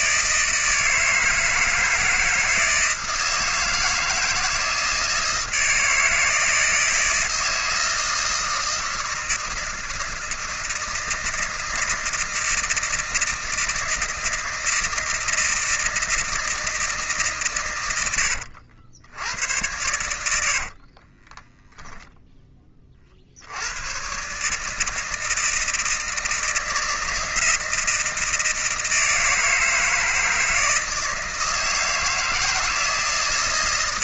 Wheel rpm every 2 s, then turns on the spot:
160, 160, 160, 160, 160, 160, 160, 160, 160, 80, 80, 10, 140, 160, 160, 160, 160.
20-22